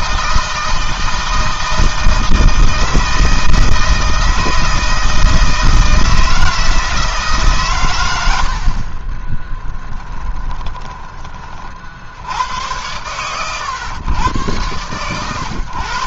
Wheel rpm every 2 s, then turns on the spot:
160, 160, 160, 160, 50, 20, 100, 120.
8-12